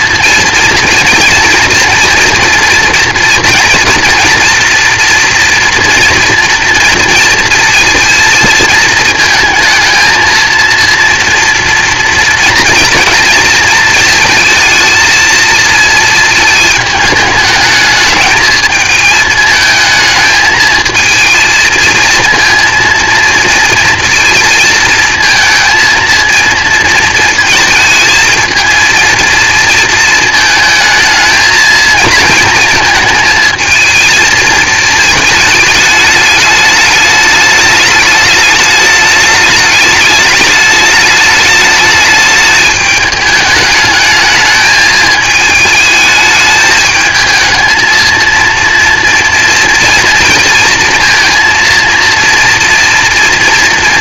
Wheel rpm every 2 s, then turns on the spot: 230, 230, 230, 230, 220, 230, 230, 230, 220, 210, 220, 230, 220, 230, 220, 220, 230, 220, 210, 210, 210, 210, 220, 220, 230, 230, 230.
none